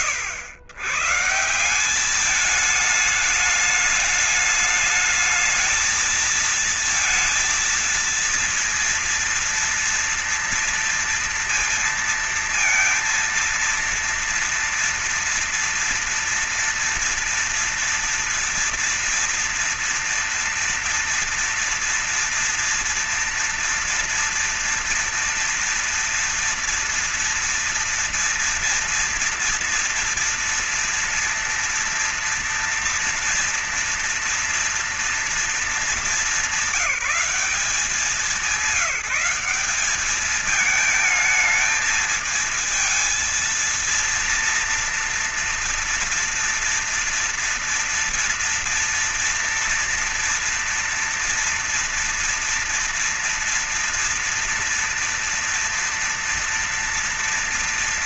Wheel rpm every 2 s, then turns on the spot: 120, 210, 210, 230, 230, 230, 230, 230, 230, 230, 230, 230, 230, 230, 230, 230, 230, 230, 190, 190, 210, 220, 230, 230, 240, 230, 240, 240, 230.
none